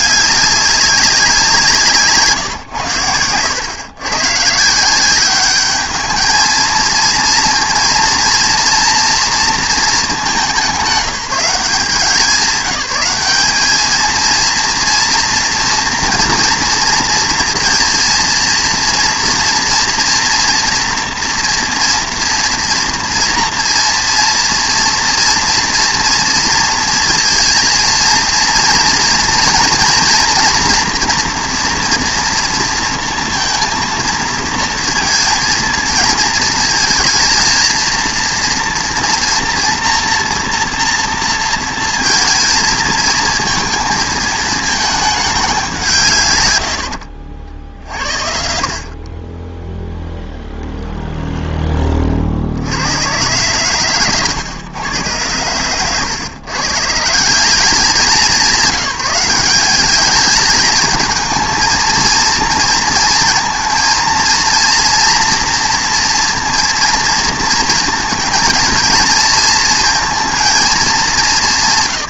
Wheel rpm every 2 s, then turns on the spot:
200, 120, 150, 220, 230, 180, 200, 230, 230, 230, 230, 230, 230, 230, 230, 240, 230, 230, 220, 230, 240, 220, 220, 110, 50, 0, 70, 110, 130, 190, 210, 230, 230, 230, 230, 220.
none